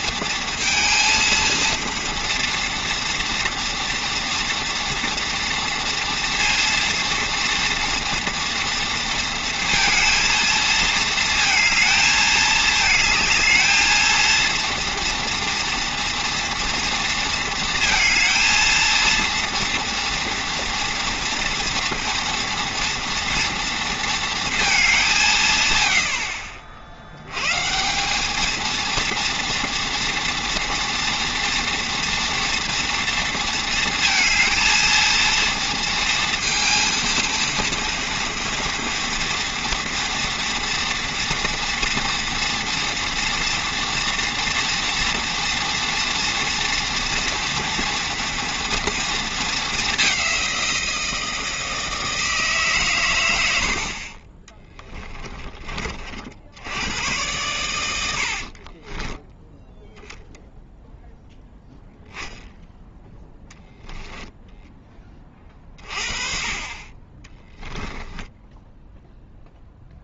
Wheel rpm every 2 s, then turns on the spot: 230, 230, 230, 230, 230, 220, 220, 230, 230, 220, 230, 230, 210, 70, 230, 230, 230, 230, 230, 230, 240, 230, 230, 230, 230, 170, 130, 10, 90, 40, 0, 10, 10, 30, 10.
54-56 58-60